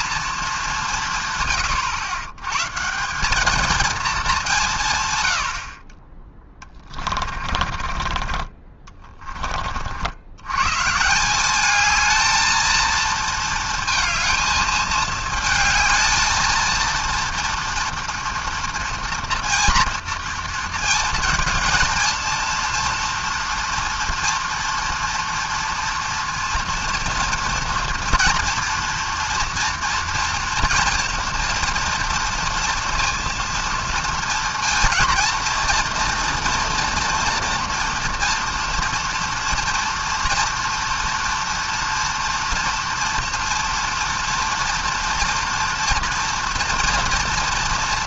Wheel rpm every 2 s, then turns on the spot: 200, 140, 160, 20, 20, 120, 230, 220, 230, 230, 230, 230, 230, 230, 230, 230, 230, 230, 230, 230, 230, 230, 230, 230.
6-8